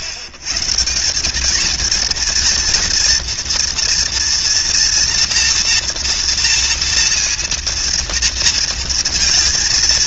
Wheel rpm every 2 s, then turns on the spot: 90, 230, 230, 230, 230.
none